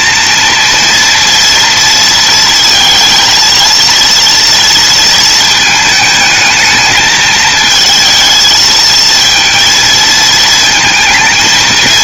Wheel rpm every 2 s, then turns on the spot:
230, 230, 220, 220, 230, 230.
none